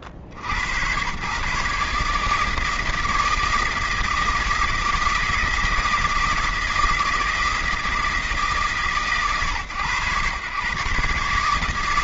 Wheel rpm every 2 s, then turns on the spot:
90, 160, 160, 160, 160, 120.
none